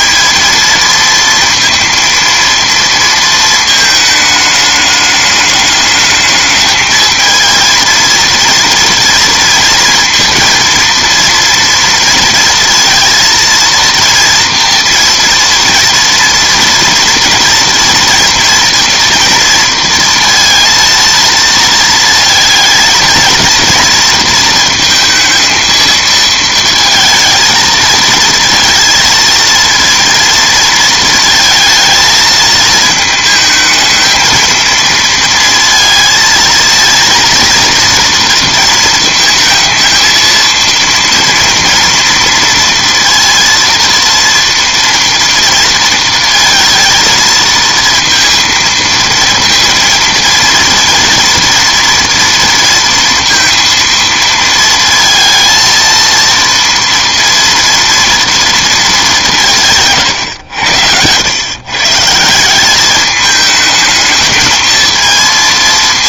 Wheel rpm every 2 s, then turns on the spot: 230, 230, 210, 210, 230, 230, 230, 230, 230, 240, 230, 230, 230, 230, 230, 230, 220, 220, 230, 230, 230, 230, 230, 220, 230, 230, 230, 230, 230, 200, 90, 200, 220.
none